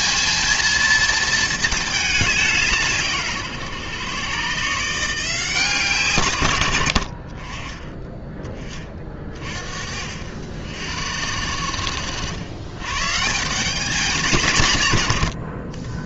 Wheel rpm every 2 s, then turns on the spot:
230, 200, 130, 110, 20, 60, 110, 140.
none